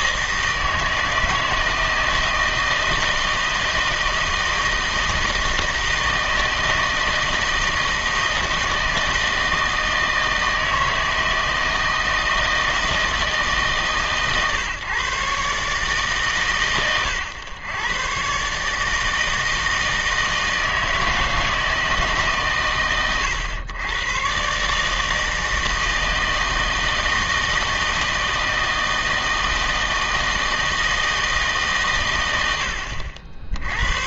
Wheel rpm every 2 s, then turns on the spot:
160, 160, 160, 160, 160, 160, 160, 140, 120, 160, 160, 130, 150, 160, 160, 160, 80.
none